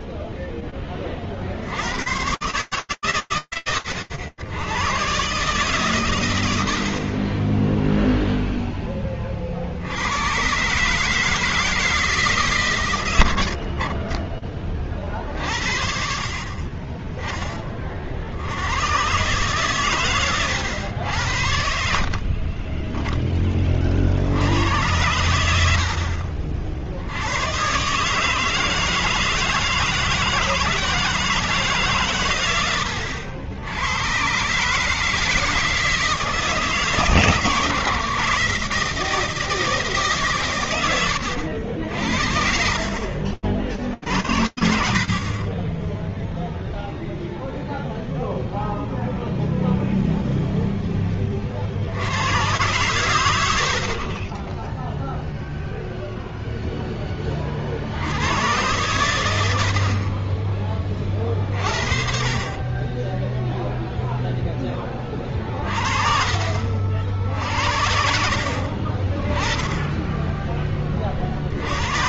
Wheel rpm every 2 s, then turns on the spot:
0, 90, 100, 120, 0, 100, 160, 40, 50, 80, 120, 40, 90, 70, 160, 160, 100, 150, 160, 160, 100, 50, 60, 0, 0, 60, 70, 0, 70, 40, 40, 0, 30, 60, 10, 90.
14-16 40-46 64-66 68-70